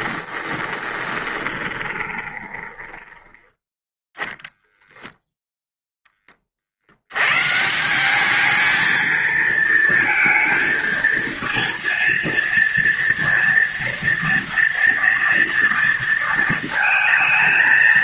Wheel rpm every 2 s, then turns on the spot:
20, 20, 0, 40, 220, 220, 230, 230, 230.
0-4